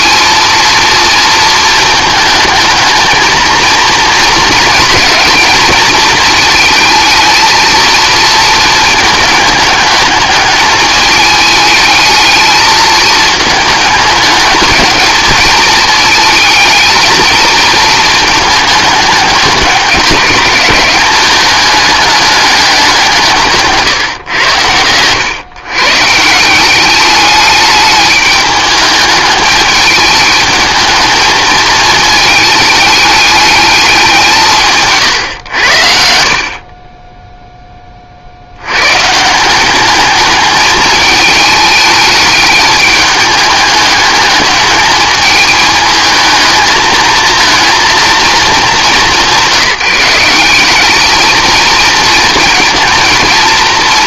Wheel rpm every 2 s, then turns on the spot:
230, 220, 220, 220, 220, 220, 220, 210, 220, 210, 200, 200, 100, 180, 210, 220, 210, 160, 30, 100, 210, 210, 220, 220, 210, 200, 230.
36-38